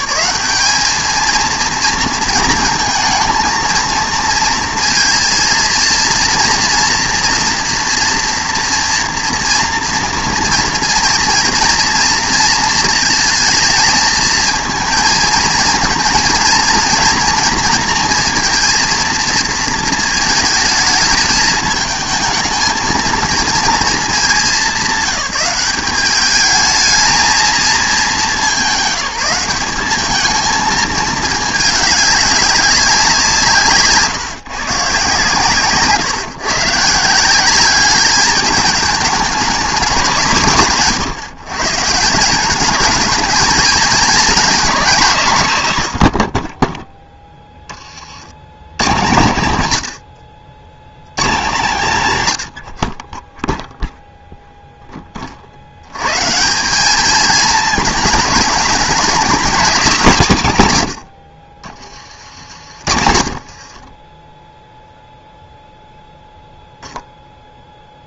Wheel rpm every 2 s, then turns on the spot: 210, 230, 230, 230, 230, 230, 220, 220, 240, 230, 220, 220, 190, 210, 180, 220, 190, 140, 140, 210, 120, 210, 210, 10, 120, 110, 50, 0, 180, 210, 120, 70, 0, 0.
none